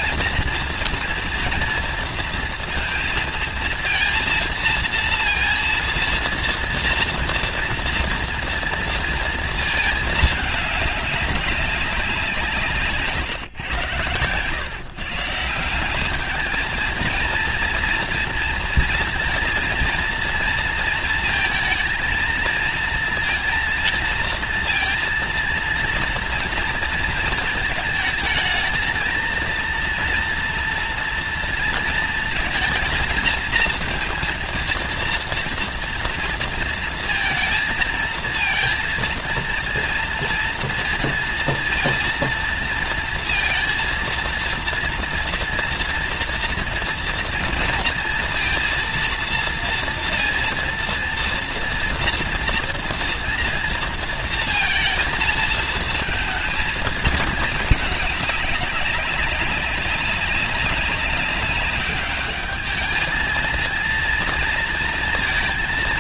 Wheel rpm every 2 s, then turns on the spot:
230, 230, 230, 230, 230, 210, 160, 120, 220, 230, 230, 220, 230, 230, 220, 230, 230, 230, 230, 230, 230, 230, 230, 230, 230, 230, 230, 230, 220, 200, 190, 210, 230.
none